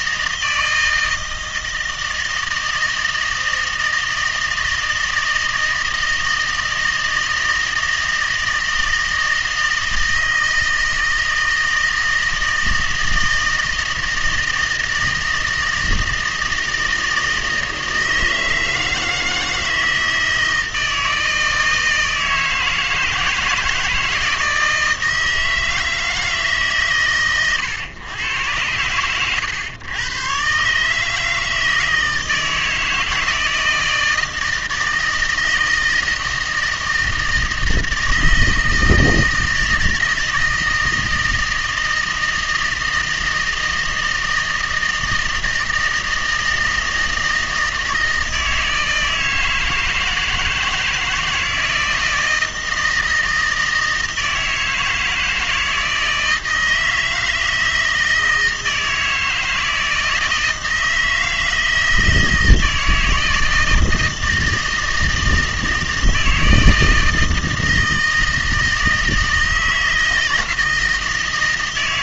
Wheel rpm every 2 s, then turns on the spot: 160, 160, 160, 160, 160, 160, 160, 160, 160, 160, 160, 160, 160, 140, 100, 130, 160, 160, 160, 160, 160, 160, 160, 160, 160, 170, 160, 160, 160, 160, 160, 160, 160, 160, 160, 160.
none